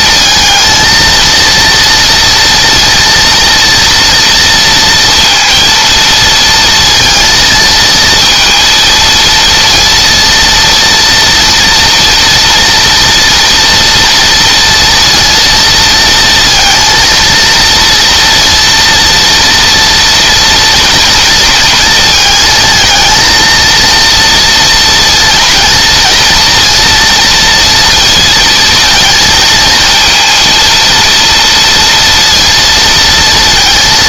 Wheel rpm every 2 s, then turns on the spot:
230, 230, 230, 230, 230, 230, 240, 230, 230, 230, 230, 230, 230, 230, 230, 230, 230.
none